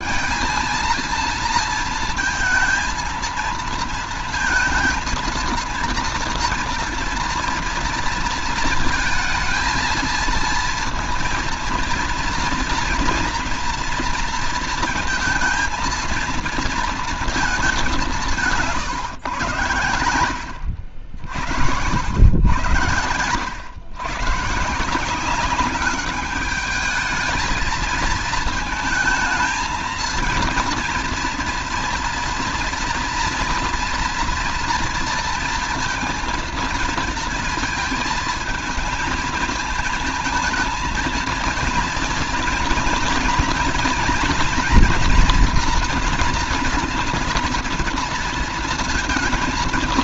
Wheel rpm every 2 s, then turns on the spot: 230, 230, 230, 230, 230, 230, 230, 230, 230, 170, 80, 90, 130, 210, 220, 230, 230, 240, 230, 220, 220, 230, 240, 230, 230.
none